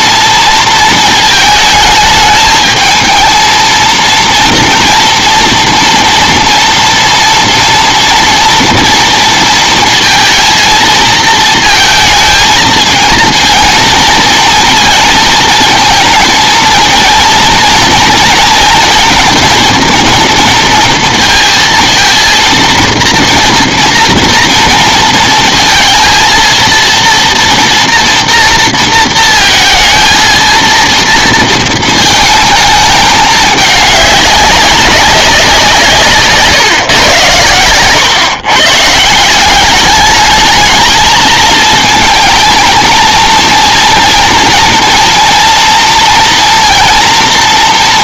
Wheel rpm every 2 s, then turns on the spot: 230, 220, 230, 230, 230, 220, 230, 230, 230, 230, 230, 230, 230, 230, 230, 230, 220, 200, 120, 150, 220, 230, 230, 230.
none